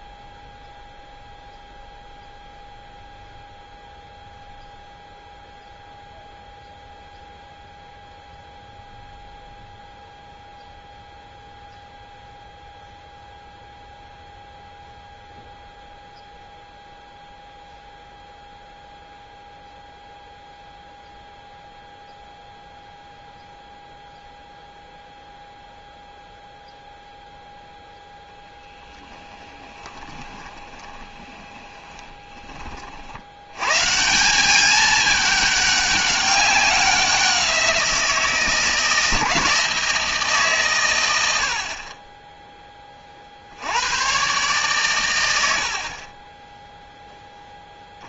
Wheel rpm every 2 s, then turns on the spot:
0, 0, 0, 0, 0, 0, 0, 0, 0, 0, 0, 0, 0, 0, 0, 20, 30, 190, 200, 160, 140, 10, 130, 10.
30-32